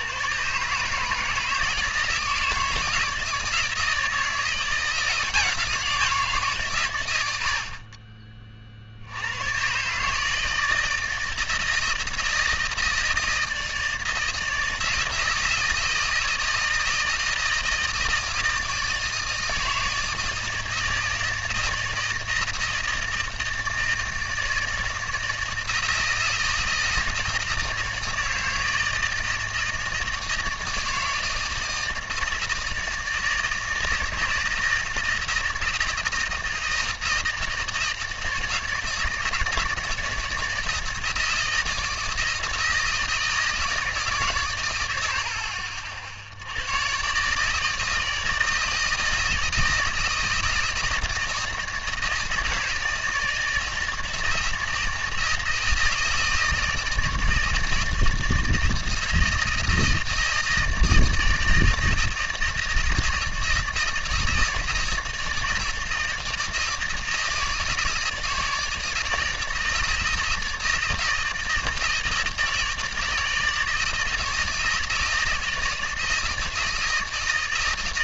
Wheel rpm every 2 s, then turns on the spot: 140, 160, 170, 130, 40, 160, 160, 160, 160, 160, 160, 160, 160, 160, 160, 160, 160, 170, 160, 160, 160, 160, 100, 100, 160, 160, 160, 160, 160, 160, 160, 160, 160, 160, 160, 160, 160, 160, 160.
none